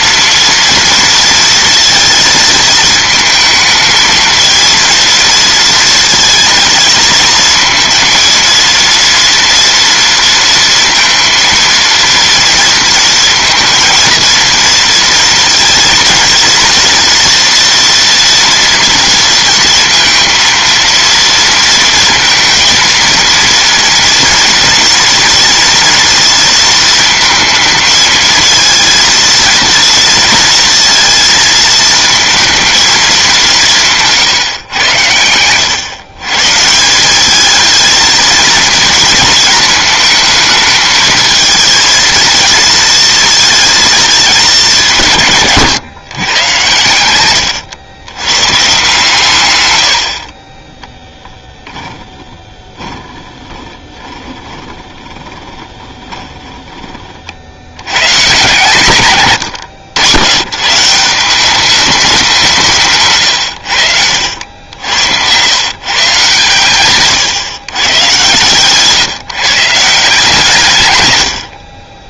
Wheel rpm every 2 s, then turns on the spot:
230, 230, 220, 230, 230, 230, 230, 230, 230, 230, 230, 230, 230, 230, 220, 230, 230, 150, 140, 230, 220, 220, 220, 130, 130, 30, 30, 20, 20, 130, 120, 170, 80, 130, 130, 130.
52-56 64-66